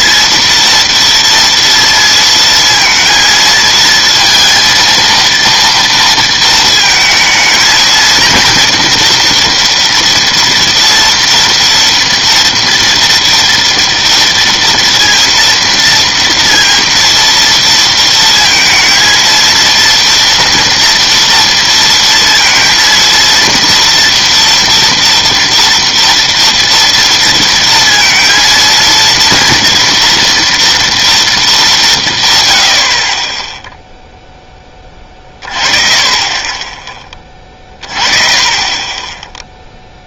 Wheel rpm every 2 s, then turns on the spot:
230, 230, 230, 220, 230, 230, 230, 230, 230, 230, 230, 230, 230, 230, 230, 230, 80, 20, 20, 20.
none